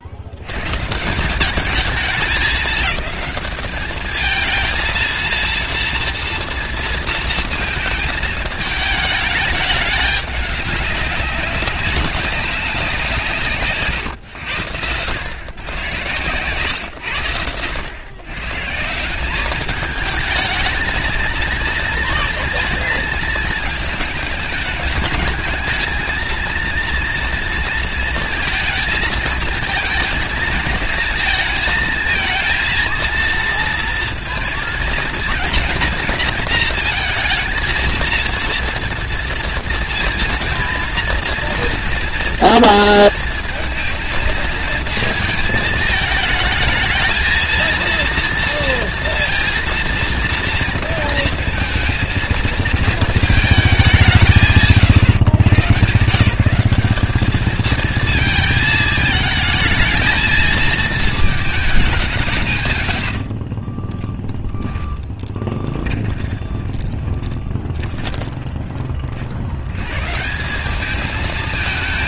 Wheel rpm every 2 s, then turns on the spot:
110, 200, 220, 230, 220, 200, 190, 100, 110, 160, 220, 230, 210, 230, 230, 230, 220, 230, 230, 230, 230, 230, 220, 220, 230, 230, 220, 110, 190, 220, 230, 130, 10, 20, 20, 190.
64-68